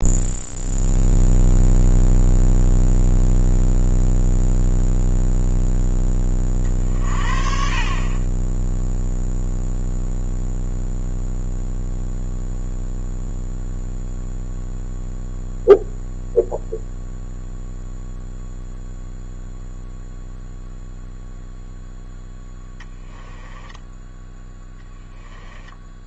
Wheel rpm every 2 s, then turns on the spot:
0, 0, 0, 40, 0, 0, 0, 0, 0, 0, 0, 10, 10.
22-26